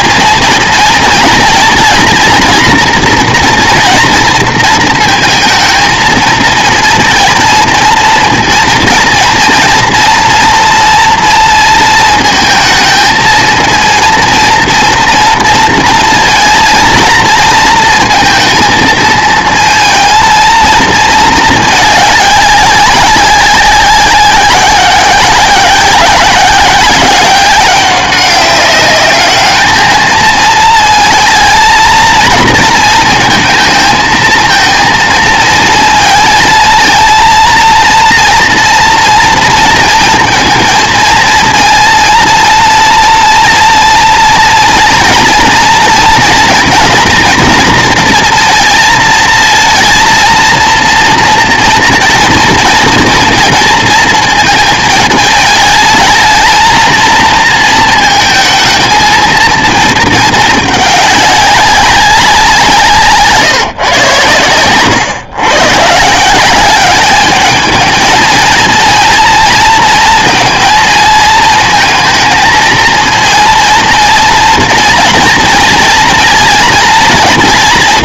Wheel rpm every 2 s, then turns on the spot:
230, 230, 230, 220, 230, 230, 220, 230, 230, 220, 220, 200, 190, 190, 200, 220, 230, 220, 220, 230, 230, 230, 230, 230, 230, 230, 230, 230, 220, 220, 220, 190, 120, 190, 220, 230, 230, 230, 230.
none